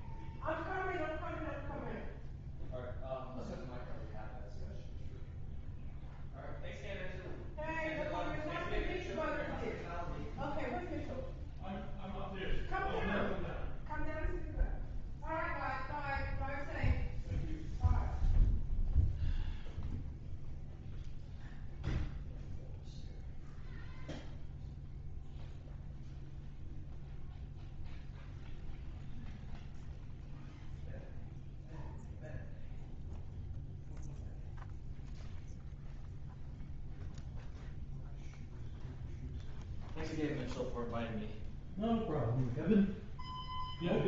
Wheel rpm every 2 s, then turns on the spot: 0, 0, 0, 0, 0, 0, 0, 0, 0, 0, 0, 0, 0, 0, 0, 0, 0, 0, 0, 0, 0, 0.
none